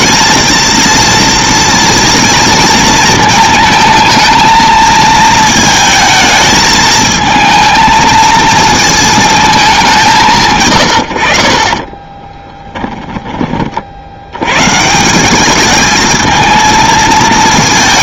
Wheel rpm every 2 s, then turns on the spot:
230, 220, 220, 220, 220, 130, 10, 120, 220.
12-14